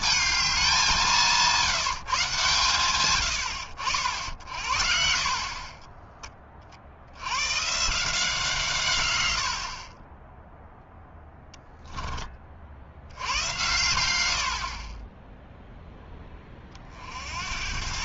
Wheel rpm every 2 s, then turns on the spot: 210, 140, 60, 40, 170, 10, 40, 70, 30.
10-12